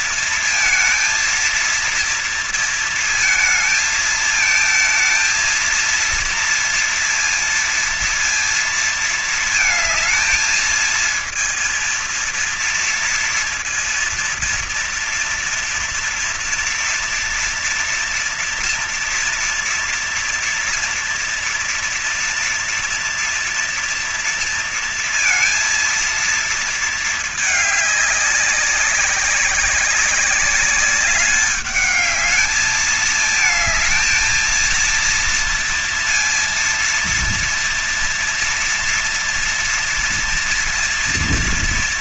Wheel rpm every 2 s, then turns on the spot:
230, 230, 230, 230, 230, 230, 230, 230, 240, 230, 230, 230, 230, 220, 200, 200, 220, 230, 230, 230, 230.
none